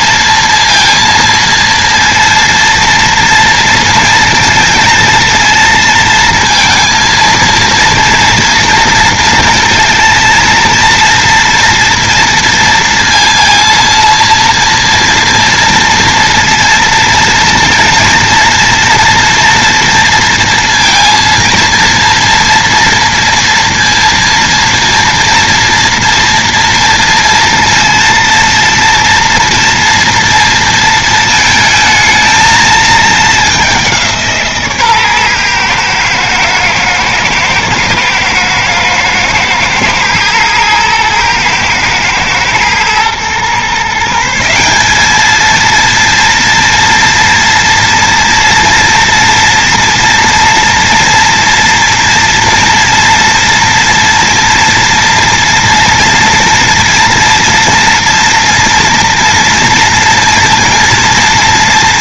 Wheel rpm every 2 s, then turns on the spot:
230, 230, 230, 230, 230, 230, 230, 230, 230, 230, 230, 230, 240, 240, 230, 230, 220, 150, 110, 110, 120, 120, 180, 230, 230, 230, 230, 230, 230, 230, 230.
none